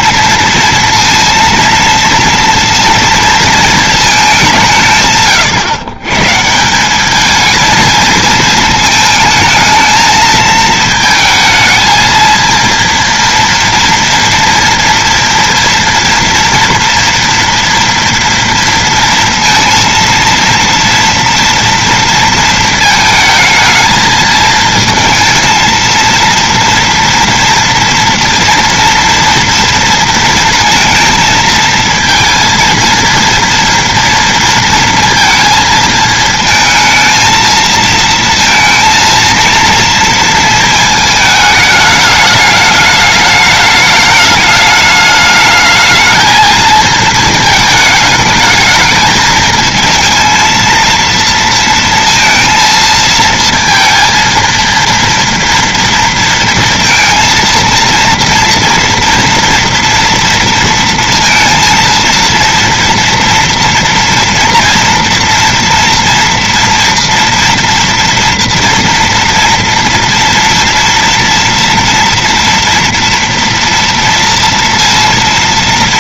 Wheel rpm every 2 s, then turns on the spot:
230, 230, 220, 140, 220, 220, 230, 230, 230, 230, 230, 230, 220, 230, 230, 230, 230, 230, 220, 230, 230, 210, 210, 220, 220, 220, 230, 230, 230, 230, 230, 230, 240, 240, 230, 230, 230, 230.
none